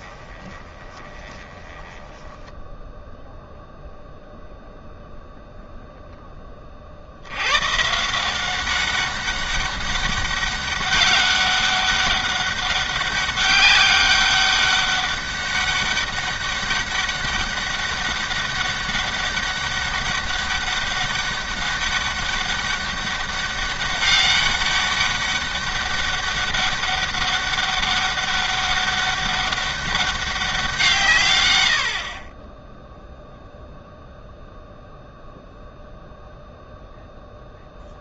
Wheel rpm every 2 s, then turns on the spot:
20, 10, 0, 40, 190, 200, 200, 200, 200, 200, 200, 200, 200, 200, 200, 170, 10, 0, 0.
0-2